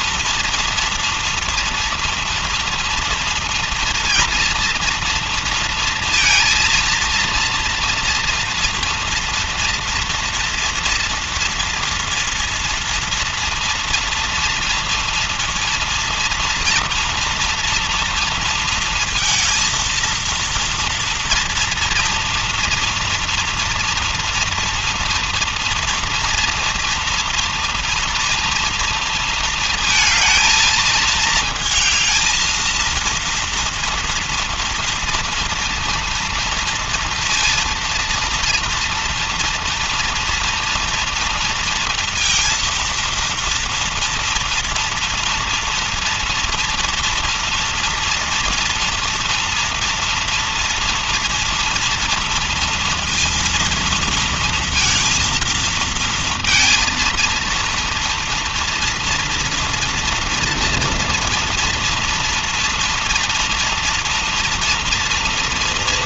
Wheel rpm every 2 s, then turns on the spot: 230, 230, 230, 230, 230, 240, 230, 240, 240, 230, 230, 230, 230, 230, 230, 220, 220, 230, 230, 230, 230, 230, 230, 240, 230, 230, 230, 230, 230, 230, 230, 230, 230.
none